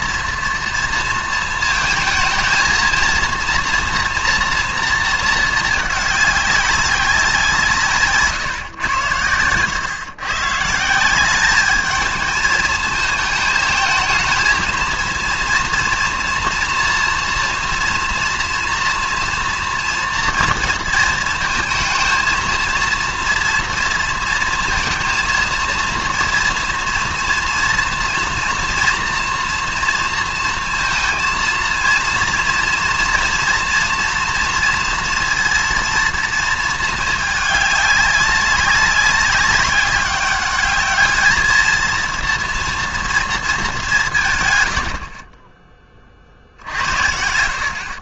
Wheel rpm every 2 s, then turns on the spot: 240, 230, 230, 200, 140, 150, 220, 220, 230, 230, 230, 230, 230, 230, 230, 230, 230, 230, 230, 190, 200, 230, 120, 60.
none